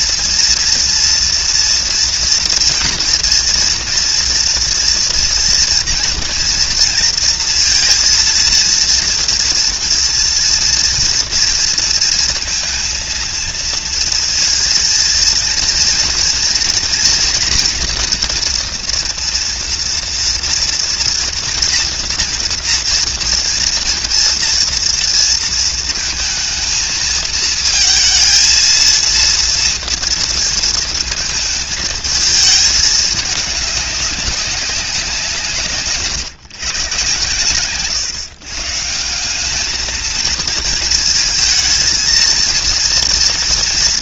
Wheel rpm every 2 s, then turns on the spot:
230, 230, 230, 230, 230, 230, 230, 230, 240, 230, 230, 230, 230, 220, 230, 230, 220, 190, 140, 150, 220, 230.
none